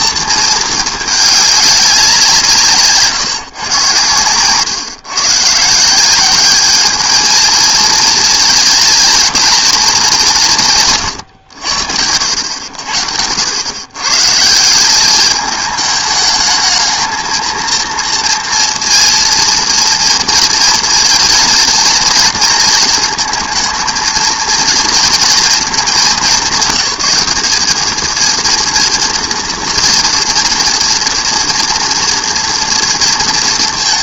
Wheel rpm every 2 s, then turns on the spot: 220, 170, 120, 200, 220, 170, 80, 160, 220, 230, 230, 230, 230, 180, 230, 240, 230.
none